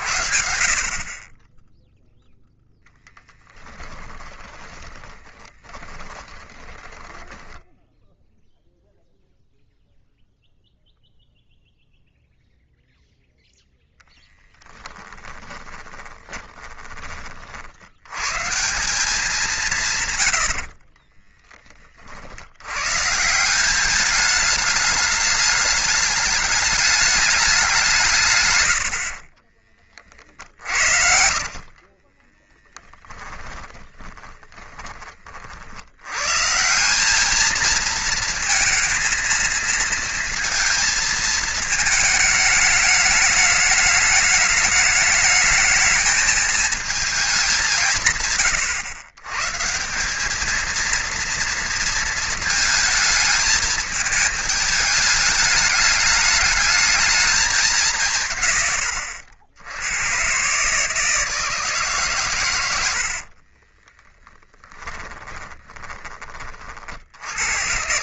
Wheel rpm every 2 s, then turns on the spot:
50, 0, 20, 10, 0, 0, 0, 10, 30, 190, 40, 120, 210, 210, 80, 70, 10, 30, 180, 230, 230, 210, 210, 220, 120, 230, 220, 210, 210, 110, 140, 80, 10, 50.
4-8 14-16 20-22 30-34 64-66